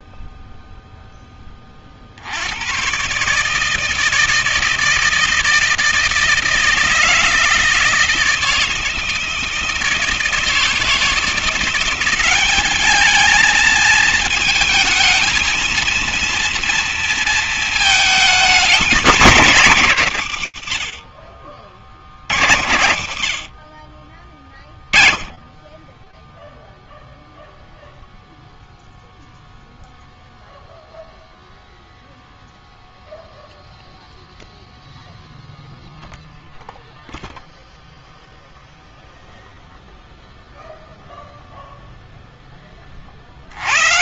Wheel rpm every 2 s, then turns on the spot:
0, 50, 160, 160, 160, 160, 190, 220, 230, 220, 160, 90, 20, 0, 0, 0, 0, 0, 0, 0, 0, 60.
none